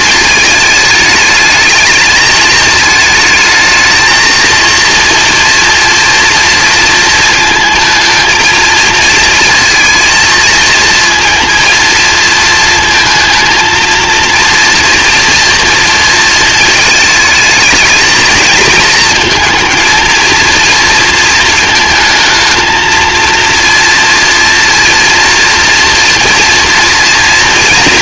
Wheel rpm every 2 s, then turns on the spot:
220, 210, 230, 230, 220, 230, 230, 230, 220, 230, 230, 220, 230, 230.
none